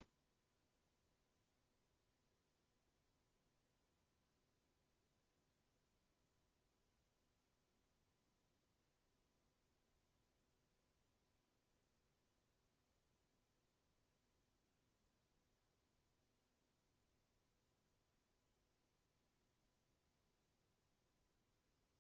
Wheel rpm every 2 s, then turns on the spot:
0, 0, 0, 0, 0, 0, 0, 0, 0, 0, 0.
none